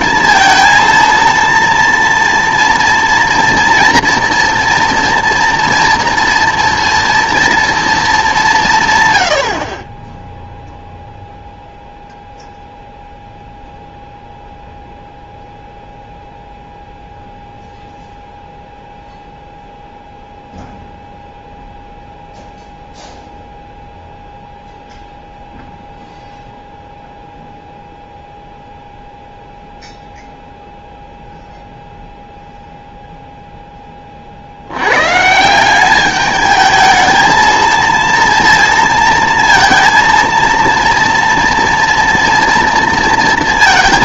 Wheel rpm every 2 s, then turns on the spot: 230, 230, 230, 230, 160, 0, 0, 0, 0, 0, 0, 0, 0, 0, 0, 0, 0, 80, 220, 230, 230, 230.
none